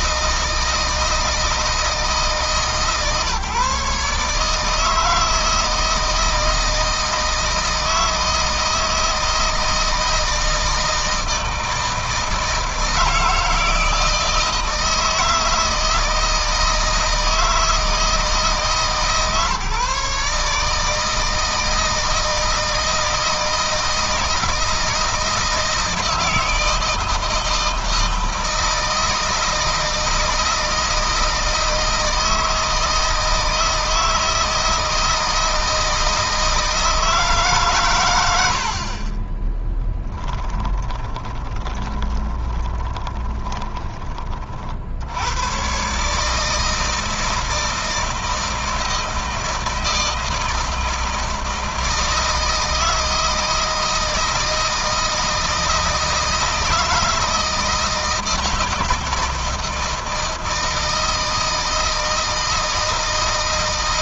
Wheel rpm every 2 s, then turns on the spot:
160, 150, 160, 160, 160, 160, 160, 160, 160, 150, 150, 160, 160, 160, 160, 160, 160, 160, 160, 50, 20, 20, 70, 160, 160, 160, 160, 160, 160, 160, 160, 160.
40-44